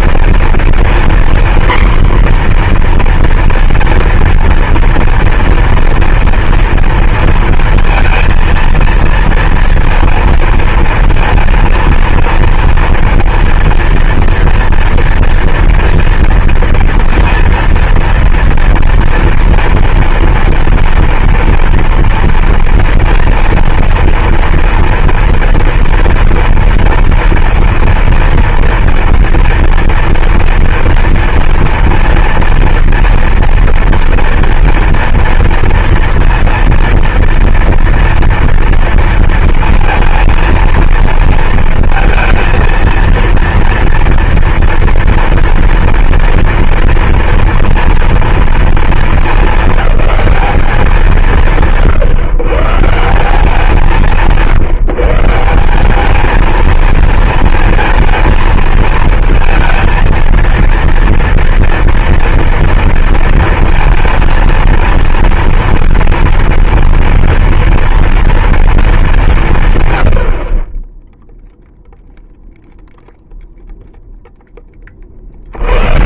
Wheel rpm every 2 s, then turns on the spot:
240, 250, 230, 230, 230, 230, 230, 230, 230, 230, 230, 230, 230, 230, 230, 240, 230, 230, 230, 230, 230, 230, 230, 230, 230, 210, 150, 160, 210, 220, 230, 230, 230, 230, 230, 60, 0, 0.
none